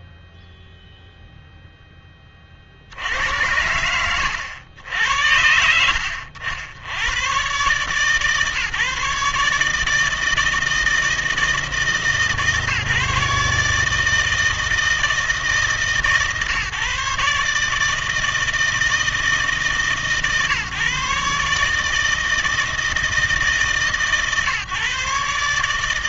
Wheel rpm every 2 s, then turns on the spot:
0, 40, 90, 70, 150, 160, 150, 160, 140, 160, 140, 160, 140.
none